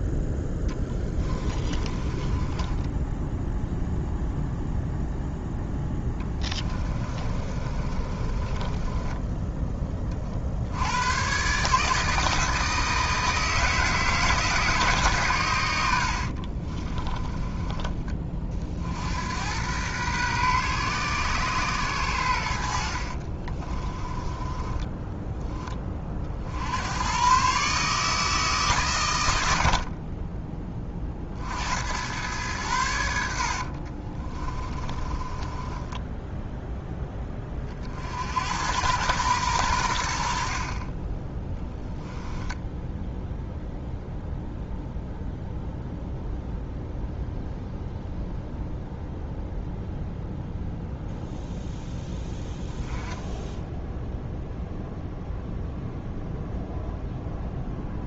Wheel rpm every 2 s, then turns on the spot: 10, 10, 0, 20, 20, 80, 160, 150, 40, 50, 130, 70, 10, 80, 140, 20, 100, 20, 0, 100, 30, 10, 0, 0, 0, 0, 10, 0, 0.
0-4 6-10 16-18 22-26 34-36 42-44